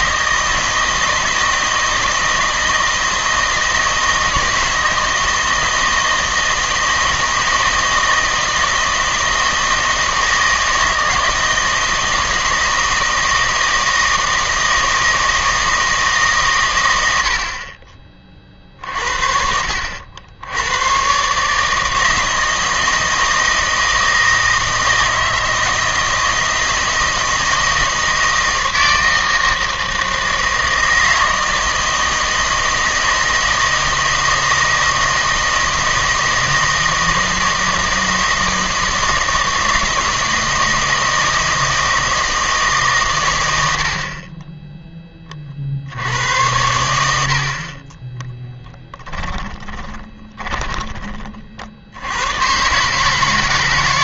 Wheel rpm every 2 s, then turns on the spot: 160, 160, 160, 160, 160, 160, 160, 160, 120, 40, 100, 160, 160, 160, 160, 160, 160, 160, 160, 160, 160, 150, 10, 90, 10, 20, 130.
48-52